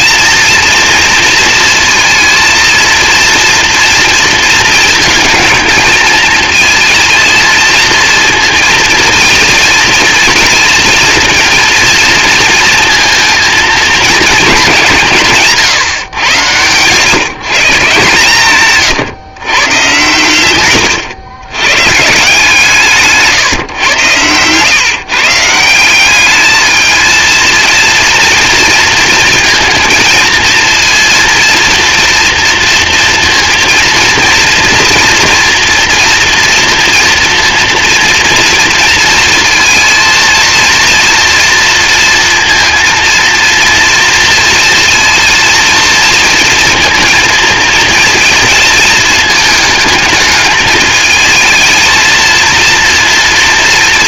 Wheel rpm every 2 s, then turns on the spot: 230, 230, 220, 230, 230, 230, 230, 190, 120, 130, 110, 150, 120, 220, 230, 230, 230, 230, 230, 230, 230, 230, 230, 230, 220, 210, 230.
20-22